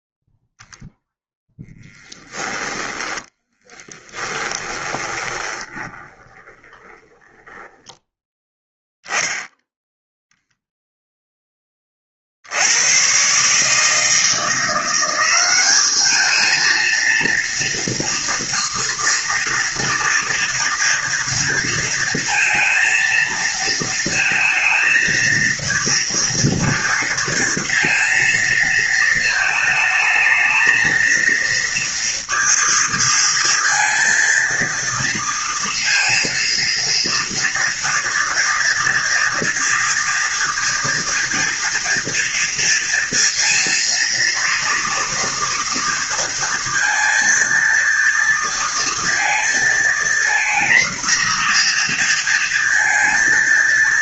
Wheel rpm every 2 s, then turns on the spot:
0, 10, 20, 20, 0, 0, 90, 170, 230, 240, 230, 230, 220, 230, 220, 220, 230, 230, 230, 240, 230, 230, 230, 230, 230, 240, 230.
2-8